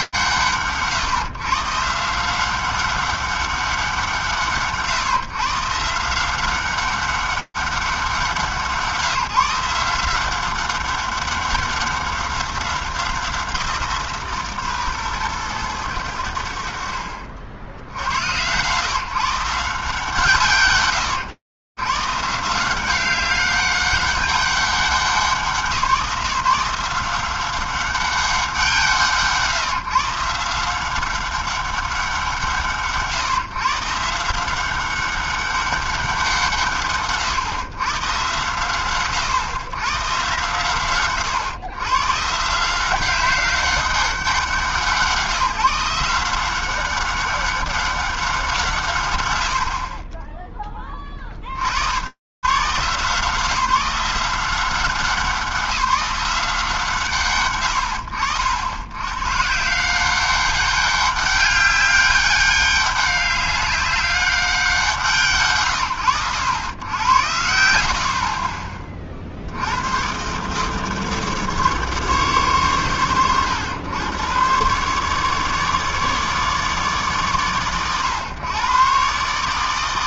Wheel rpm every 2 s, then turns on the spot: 160, 140, 170, 140, 180, 180, 190, 170, 120, 60, 140, 150, 190, 170, 190, 160, 180, 140, 190, 110, 100, 120, 190, 170, 200, 50, 90, 170, 180, 80, 180, 200, 200, 70, 80, 110, 150, 100, 150, 100.
68-70